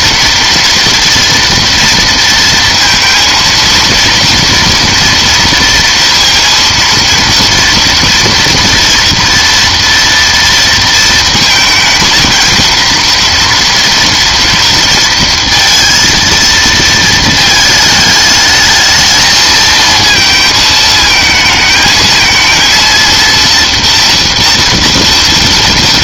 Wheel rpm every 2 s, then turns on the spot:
230, 230, 230, 230, 240, 230, 230, 230, 230, 210, 220, 230, 230.
none